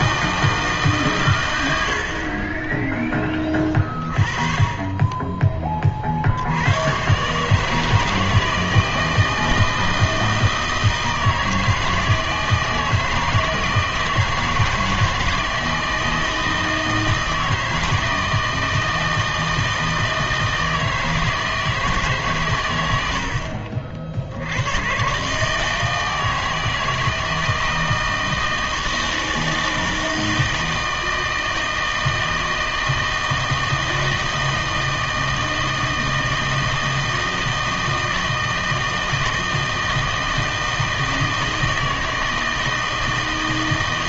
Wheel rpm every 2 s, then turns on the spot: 160, 20, 30, 90, 160, 160, 160, 160, 160, 160, 160, 110, 100, 160, 160, 160, 160, 160, 160, 160, 160, 160.
none